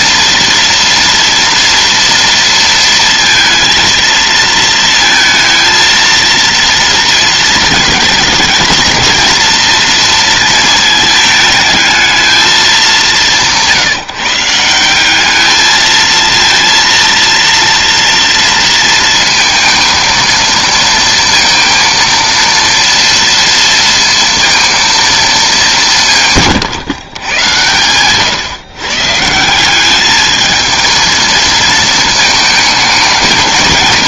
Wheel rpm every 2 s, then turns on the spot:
230, 230, 230, 230, 220, 220, 200, 180, 230, 230, 230, 230, 230, 140, 130, 220, 220.
none